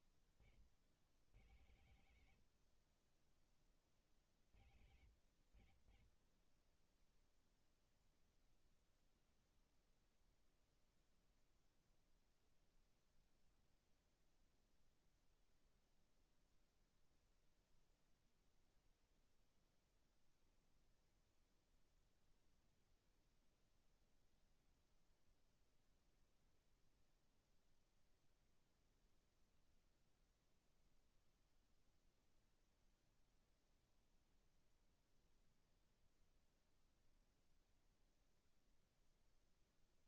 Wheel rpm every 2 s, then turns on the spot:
30, 60, 60, 20, 0, 0, 0, 0, 0, 0, 0, 0, 0, 0, 0, 0, 0, 0, 0, 0.
none